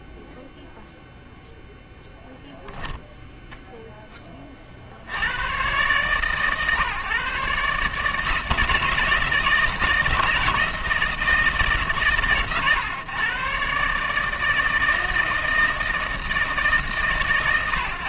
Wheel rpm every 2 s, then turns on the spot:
0, 0, 110, 140, 160, 140, 130, 160, 130.
none